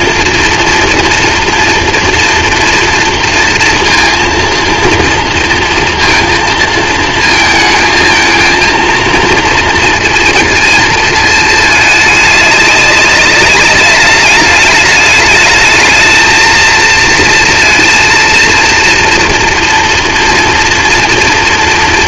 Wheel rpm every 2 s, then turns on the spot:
240, 230, 230, 220, 230, 230, 210, 210, 220, 230, 240.
none